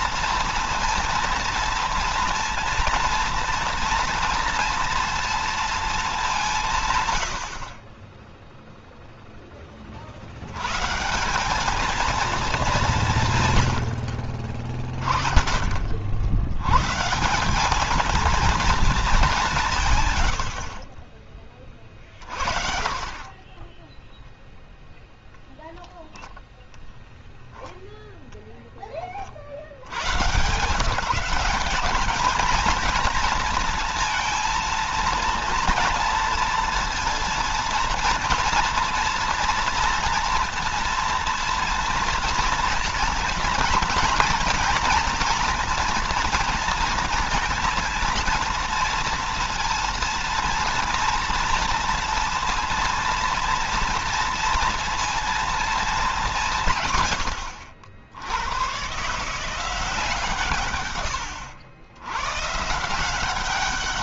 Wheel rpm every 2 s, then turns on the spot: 230, 230, 230, 150, 0, 130, 200, 30, 120, 220, 40, 40, 0, 0, 10, 150, 220, 230, 230, 230, 230, 230, 240, 230, 230, 230, 230, 230, 150, 110, 130, 150.
22-24